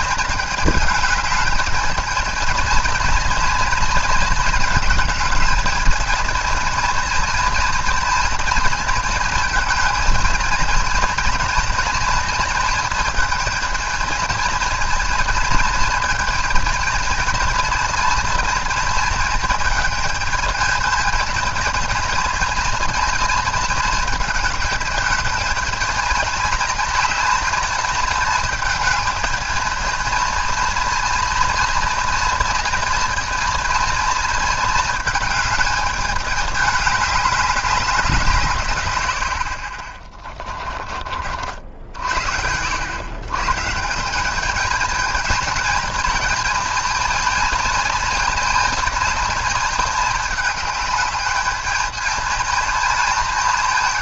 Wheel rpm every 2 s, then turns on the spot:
220, 220, 220, 230, 230, 220, 220, 220, 220, 230, 220, 230, 220, 220, 220, 230, 230, 220, 210, 150, 20, 90, 200, 220, 220, 210, 220.
40-42